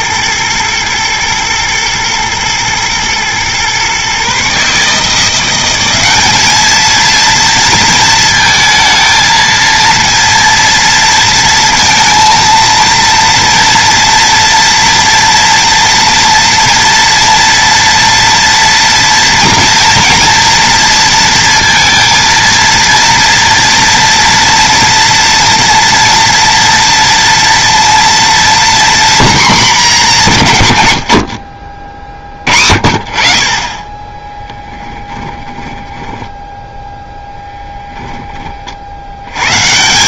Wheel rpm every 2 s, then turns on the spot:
120, 110, 150, 220, 230, 230, 230, 240, 230, 230, 230, 230, 240, 230, 240, 100, 50, 20, 10, 90.
34-38